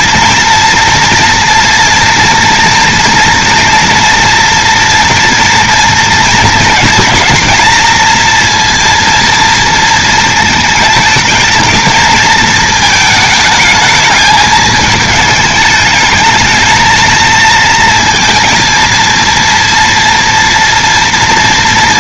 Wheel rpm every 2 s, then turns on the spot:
230, 230, 230, 220, 230, 230, 220, 220, 220, 230, 230.
none